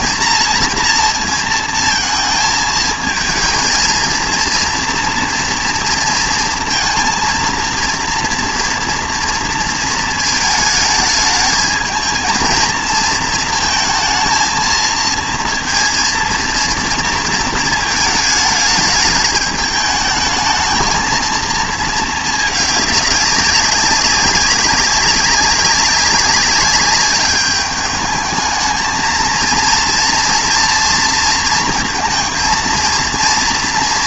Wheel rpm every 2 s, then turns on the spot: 230, 220, 230, 230, 230, 220, 230, 220, 230, 210, 220, 210, 200, 200, 220, 230, 220.
none